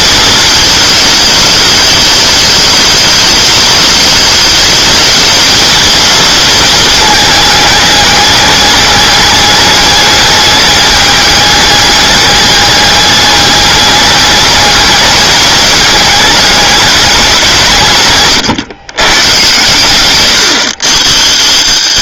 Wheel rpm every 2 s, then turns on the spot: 220, 210, 210, 220, 210, 210, 210, 210, 210, 140, 80.
none